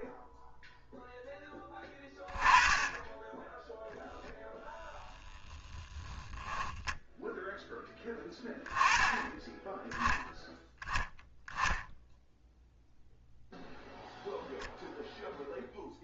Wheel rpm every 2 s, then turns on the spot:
0, 20, 0, 10, 10, 0, 0, 0.
none